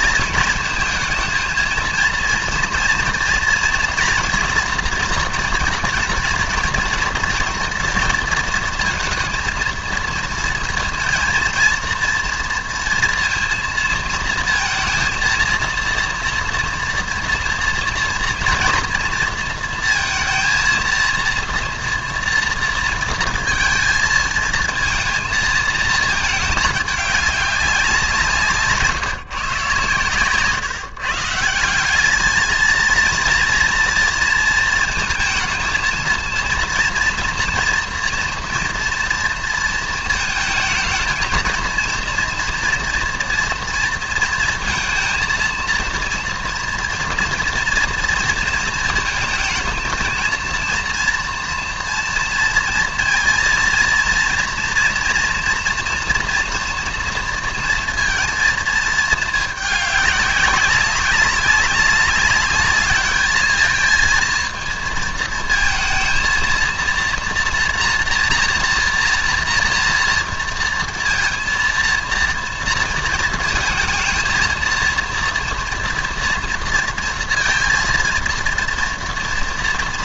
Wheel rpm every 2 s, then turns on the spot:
230, 230, 230, 230, 230, 230, 230, 230, 230, 230, 230, 230, 230, 210, 150, 140, 230, 230, 230, 230, 220, 240, 230, 240, 230, 230, 230, 230, 230, 230, 200, 210, 230, 230, 230, 230, 230, 230, 230, 230.
none